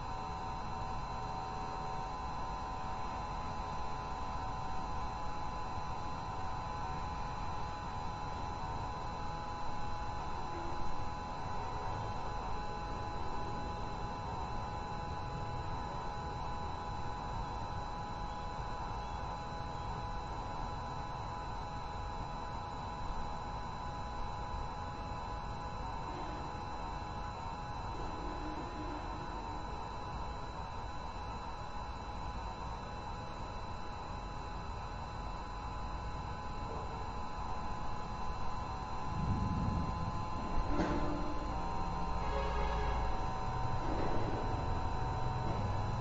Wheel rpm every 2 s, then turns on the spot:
0, 0, 0, 0, 0, 0, 0, 0, 0, 0, 0, 0, 0, 0, 0, 0, 0, 0, 0, 0, 0, 0, 0.
none